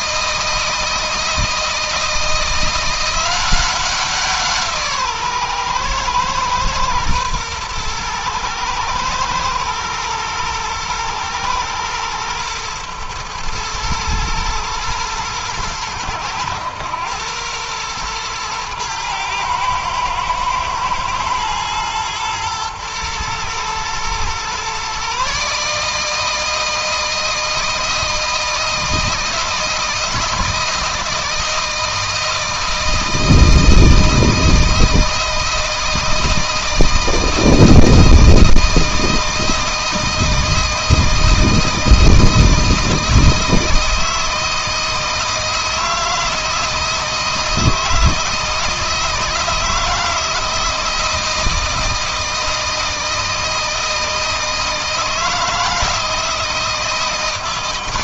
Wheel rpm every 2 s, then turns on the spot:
160, 170, 150, 120, 110, 110, 120, 120, 110, 110, 110, 120, 130, 160, 160, 160, 160, 160, 160, 160, 160, 160, 160, 160, 160, 160, 160, 160, 160.
none